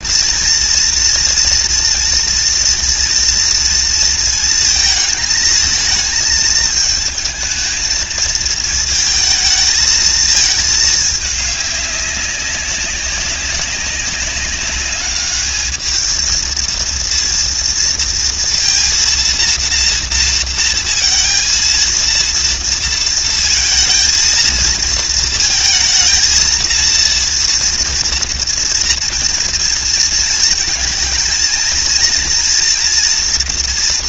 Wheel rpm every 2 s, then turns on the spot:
230, 230, 220, 220, 220, 200, 200, 210, 230, 230, 230, 230, 230, 230, 230, 220, 230.
none